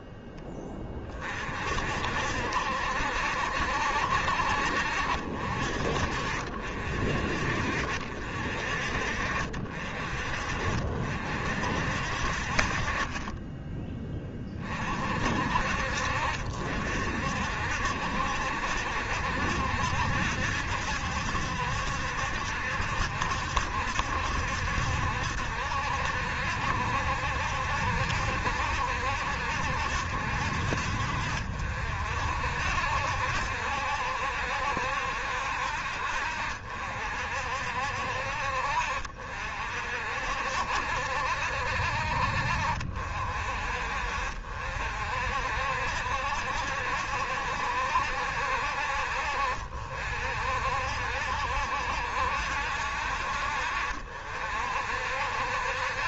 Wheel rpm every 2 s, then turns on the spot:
30, 60, 60, 50, 50, 50, 30, 40, 60, 70, 70, 70, 70, 70, 70, 60, 70, 70, 60, 50, 70, 50, 60, 70, 60, 60, 60, 60.
none